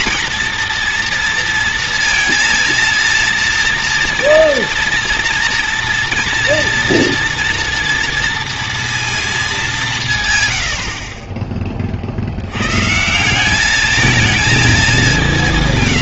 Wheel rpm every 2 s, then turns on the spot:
230, 230, 230, 230, 230, 80, 140, 210.
none